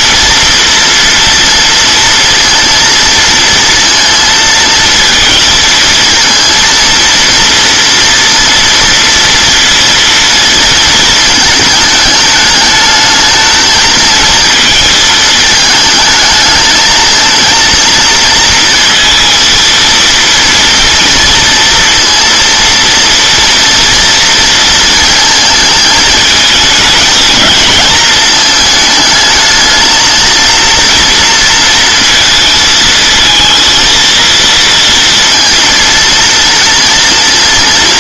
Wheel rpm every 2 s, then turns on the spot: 230, 230, 230, 230, 230, 230, 210, 220, 220, 230, 230, 230, 230, 220, 220, 230, 230, 230, 230.
none